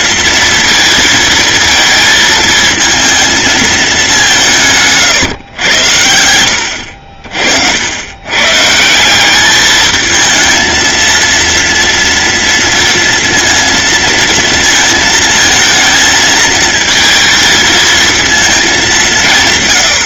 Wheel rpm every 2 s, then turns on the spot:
230, 230, 150, 60, 160, 230, 230, 230, 230, 200.
none